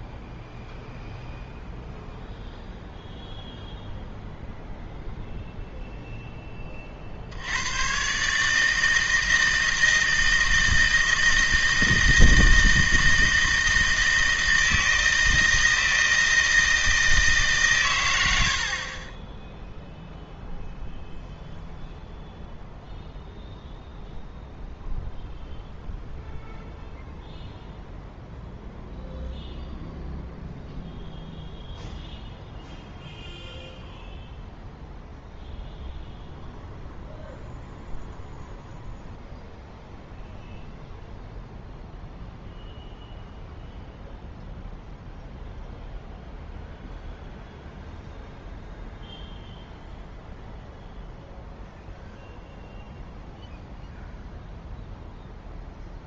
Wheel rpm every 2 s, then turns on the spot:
0, 0, 0, 10, 140, 160, 160, 160, 160, 90, 0, 0, 0, 0, 0, 0, 0, 0, 0, 0, 0, 0, 0, 0, 0, 0, 0, 0.
none